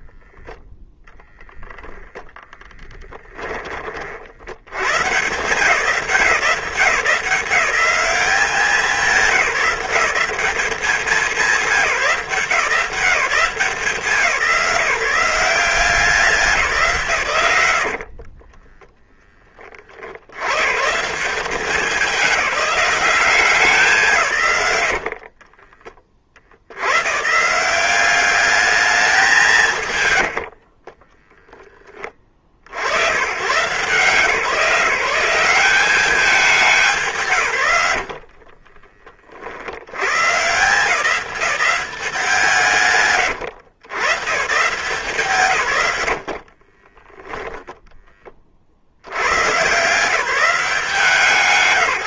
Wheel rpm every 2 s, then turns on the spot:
0, 10, 120, 180, 190, 190, 170, 170, 160, 20, 110, 190, 90, 70, 210, 60, 70, 160, 200, 40, 160, 170, 130, 30, 50, 180.
2-4 18-20 30-32 38-40 46-48